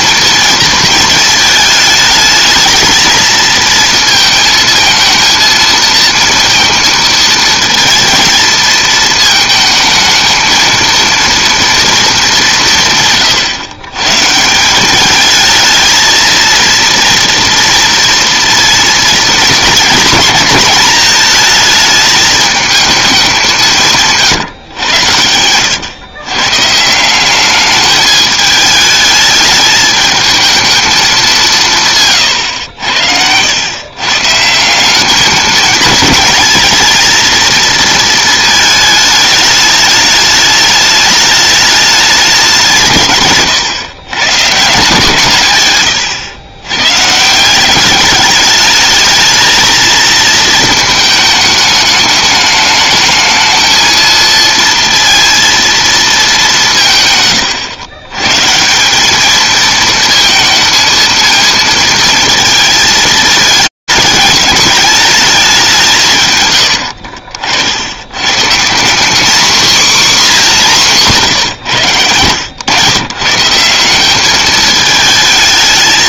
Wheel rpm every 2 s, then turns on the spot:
230, 220, 230, 230, 230, 220, 180, 160, 230, 230, 220, 220, 150, 140, 210, 220, 100, 160, 220, 220, 210, 190, 140, 110, 210, 220, 210, 230, 190, 150, 220, 220, 220, 90, 170, 210, 120, 220.
66-68